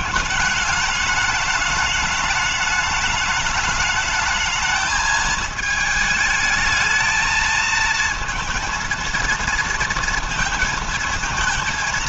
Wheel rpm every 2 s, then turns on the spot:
210, 210, 220, 220, 230, 230.
none